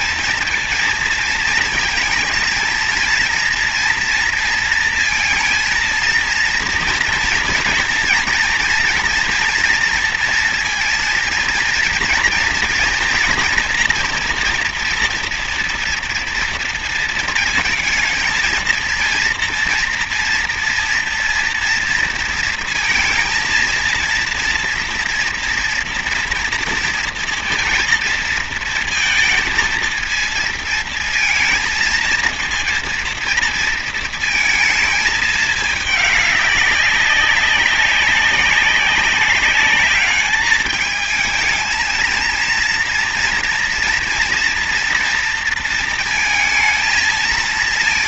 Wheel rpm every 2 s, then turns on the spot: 230, 230, 230, 230, 230, 230, 230, 230, 230, 230, 230, 230, 230, 230, 230, 230, 230, 220, 200, 200, 210, 230, 230, 220.
none